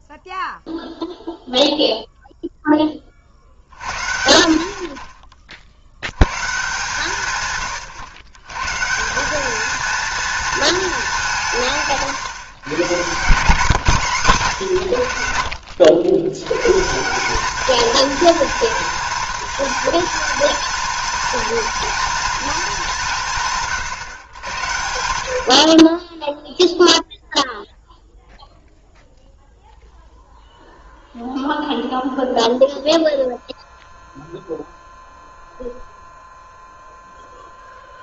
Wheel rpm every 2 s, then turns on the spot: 0, 0, 50, 150, 140, 220, 160, 120, 140, 230, 220, 200, 90, 0, 0, 0, 0, 0, 0.
none